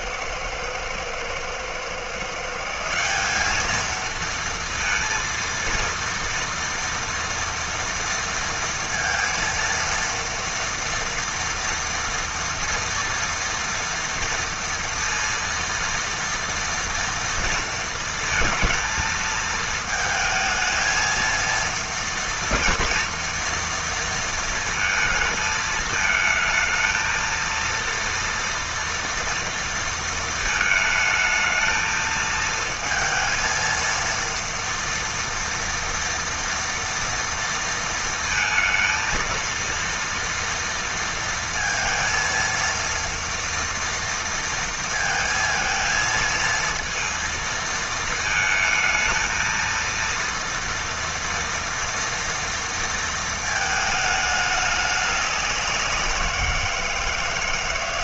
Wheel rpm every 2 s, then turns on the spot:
120, 160, 230, 240, 230, 230, 230, 230, 230, 220, 220, 230, 230, 220, 230, 220, 230, 230, 230, 230, 230, 230, 230, 230, 220, 230, 230, 210, 170.
none